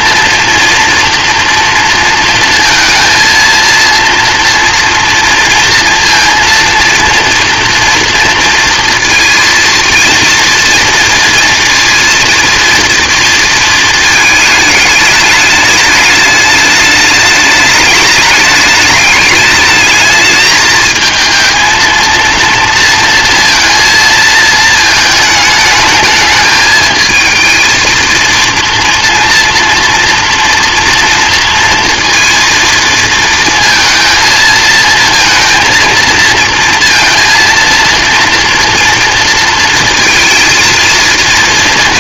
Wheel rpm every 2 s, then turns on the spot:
230, 230, 230, 230, 230, 230, 230, 210, 210, 210, 220, 230, 220, 220, 230, 230, 230, 230, 230, 230, 230.
none